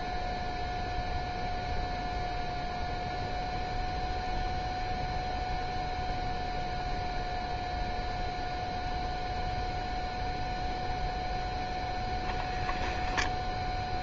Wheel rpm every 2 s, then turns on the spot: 10, 0, 0, 0, 0, 0, 0.
none